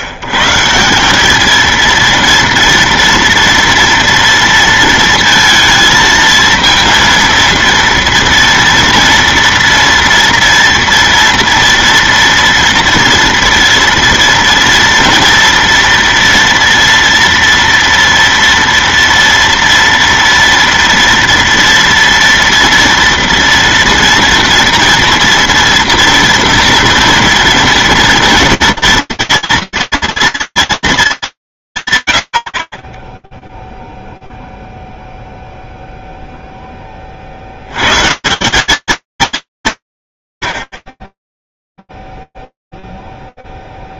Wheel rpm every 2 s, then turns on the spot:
140, 230, 230, 230, 230, 230, 230, 230, 230, 240, 230, 230, 240, 230, 230, 230, 40, 0, 0, 180, 40, 0.
none